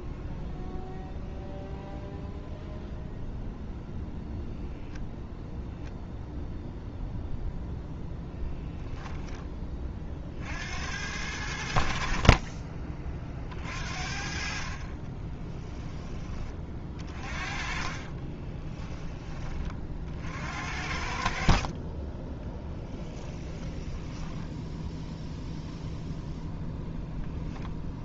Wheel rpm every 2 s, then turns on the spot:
0, 0, 0, 0, 10, 70, 30, 30, 30, 10, 60, 20, 0, 10.
14-18 22-24